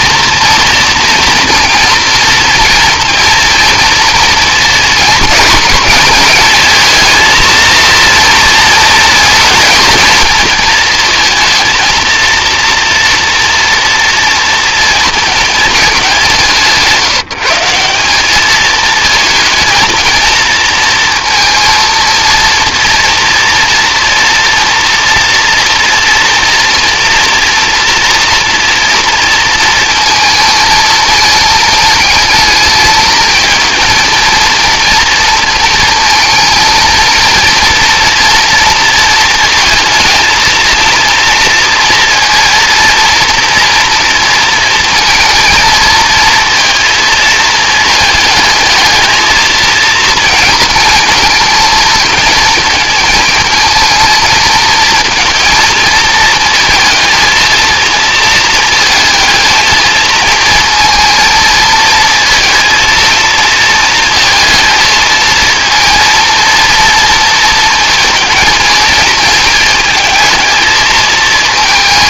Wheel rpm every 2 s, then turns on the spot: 230, 230, 220, 220, 230, 220, 230, 230, 170, 220, 230, 230, 230, 230, 230, 220, 220, 230, 230, 230, 230, 230, 230, 230, 220, 230, 220, 230, 230, 220, 220, 230, 220, 230, 220, 220.
none